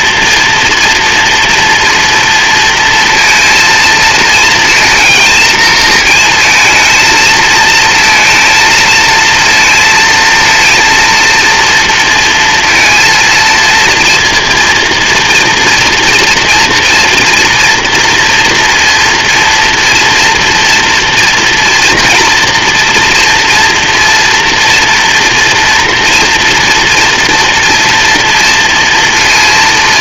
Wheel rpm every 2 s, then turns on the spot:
230, 230, 230, 230, 230, 230, 230, 240, 230, 240, 240, 230, 230, 240, 230.
none